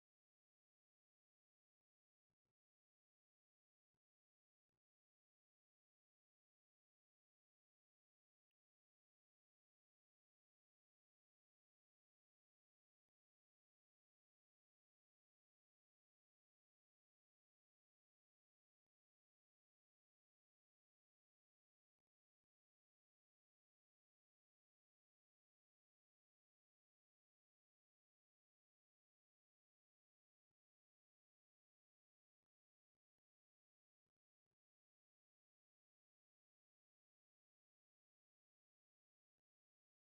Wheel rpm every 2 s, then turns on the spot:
0, 0, 0, 0, 0, 0, 0, 0, 0, 0, 0, 0, 0, 0, 0, 0, 0, 0, 0, 0.
none